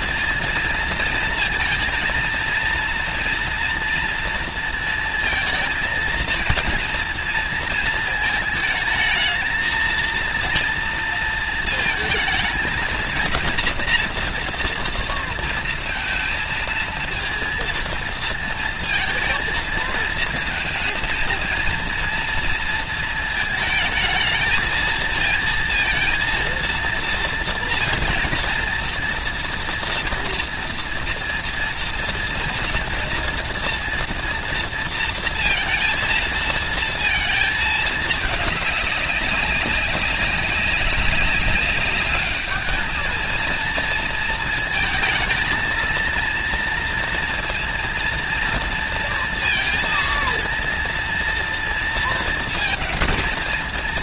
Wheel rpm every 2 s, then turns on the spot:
230, 230, 230, 230, 220, 230, 220, 240, 230, 230, 220, 230, 220, 230, 230, 240, 230, 230, 230, 210, 200, 210, 230, 230, 230, 230, 220.
none